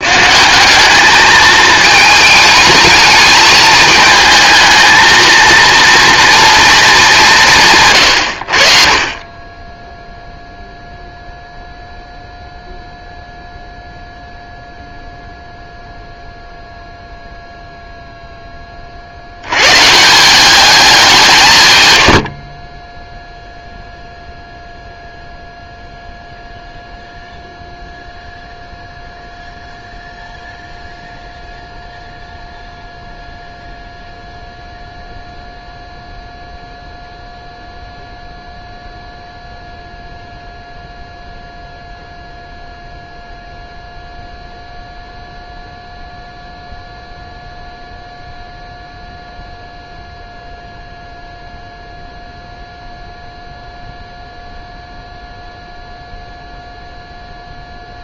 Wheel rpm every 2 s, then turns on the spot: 210, 220, 230, 200, 40, 0, 0, 0, 0, 60, 200, 10, 0, 0, 0, 0, 0, 0, 0, 0, 0, 0, 0, 0, 0, 0, 0, 0, 0.
none